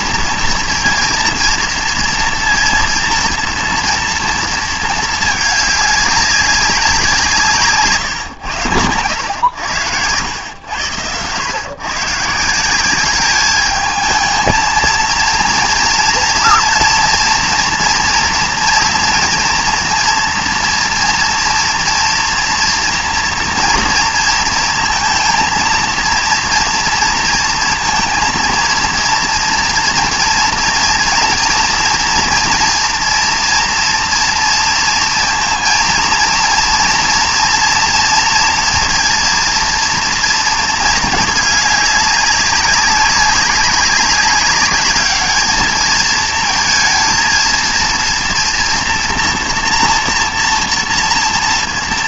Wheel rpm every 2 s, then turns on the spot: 230, 230, 230, 190, 100, 100, 180, 220, 230, 240, 230, 230, 230, 230, 230, 230, 230, 230, 230, 230, 230, 200, 200, 220, 230, 230.
none